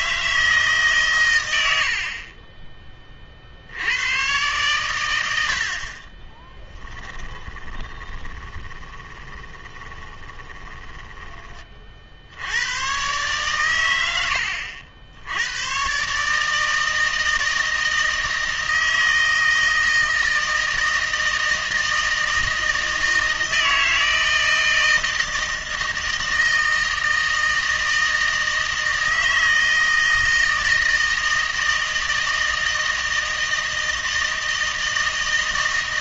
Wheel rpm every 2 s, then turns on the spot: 150, 20, 110, 20, 20, 20, 90, 80, 160, 160, 160, 160, 160, 160, 160, 160, 160, 160.
6-12